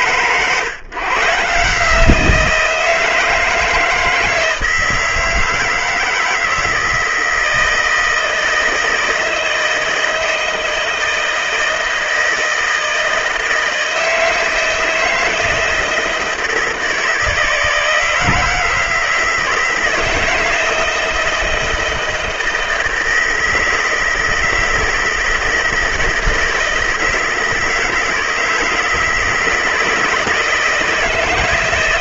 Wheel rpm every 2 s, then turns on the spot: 130, 170, 160, 160, 160, 160, 160, 160, 160, 160, 160, 160, 160, 160, 160, 160.
none